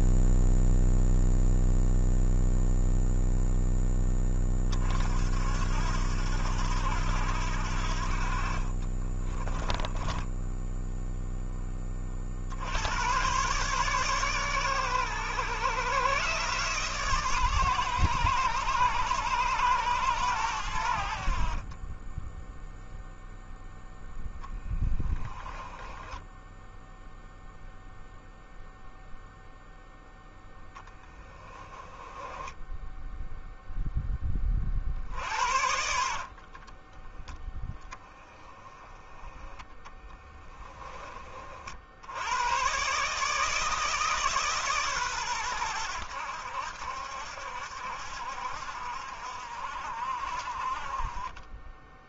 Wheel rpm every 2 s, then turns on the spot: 0, 0, 50, 80, 30, 0, 90, 120, 130, 110, 70, 0, 20, 0, 0, 10, 10, 50, 20, 20, 20, 130, 130, 80, 60, 30.
8-10 24-26 30-34 36-38